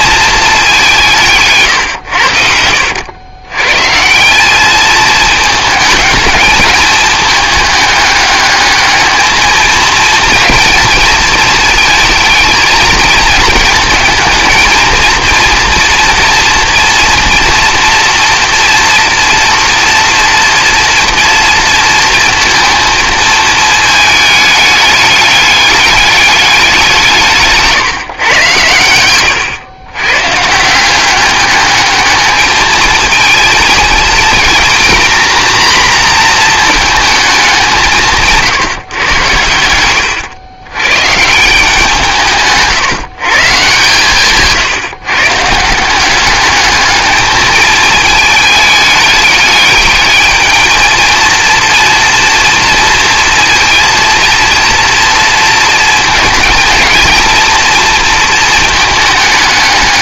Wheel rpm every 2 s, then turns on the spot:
200, 80, 210, 210, 210, 220, 220, 220, 230, 230, 230, 220, 210, 190, 100, 180, 220, 240, 230, 130, 130, 150, 150, 210, 210, 220, 230, 230, 230, 220.
28-30